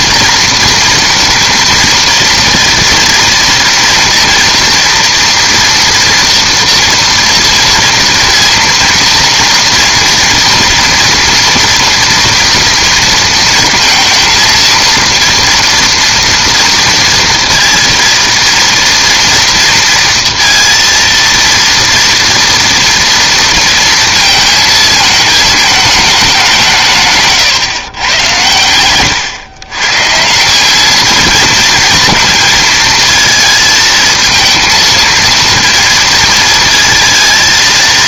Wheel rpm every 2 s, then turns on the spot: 230, 230, 230, 230, 230, 230, 230, 230, 230, 230, 230, 230, 220, 160, 110, 200, 230, 230, 230.
none